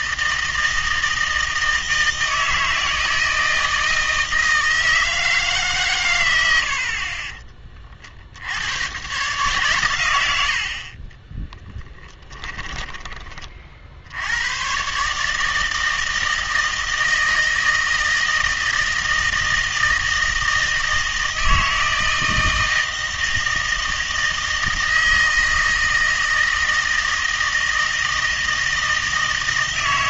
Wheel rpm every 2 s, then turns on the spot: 160, 160, 170, 70, 100, 60, 10, 120, 160, 160, 160, 160, 160, 160, 160.
12-14